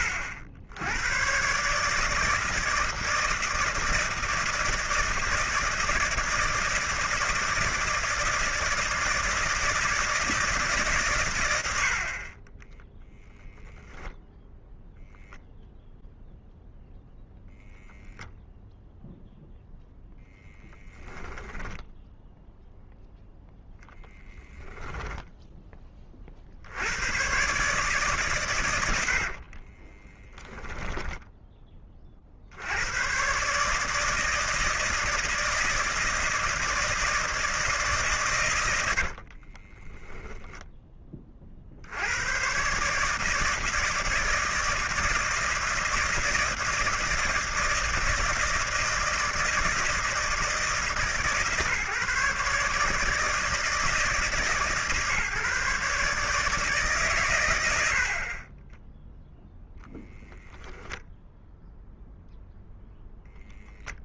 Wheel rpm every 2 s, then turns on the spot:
90, 160, 160, 160, 160, 150, 10, 0, 0, 0, 10, 0, 10, 70, 110, 10, 90, 160, 160, 90, 20, 130, 160, 160, 160, 150, 140, 150, 160, 30, 0, 0.
20-22 30-32 38-40